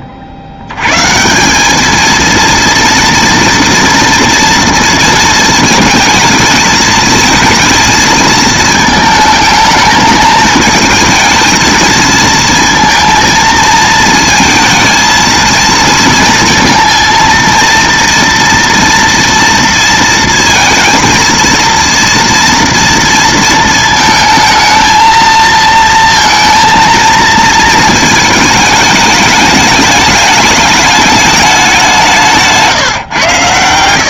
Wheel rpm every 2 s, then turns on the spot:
90, 230, 230, 220, 220, 220, 230, 220, 230, 230, 230, 230, 220, 230, 210, 210, 150.
none